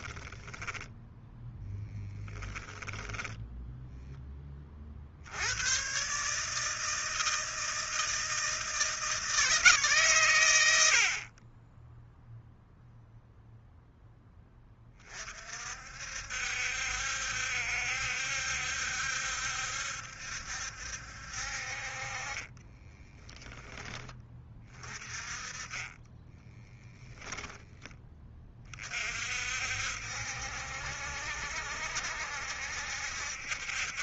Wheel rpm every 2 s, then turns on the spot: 10, 10, 40, 160, 160, 90, 0, 30, 70, 70, 70, 20, 30, 10, 30, 70, 70.
0-4 22-24 26-28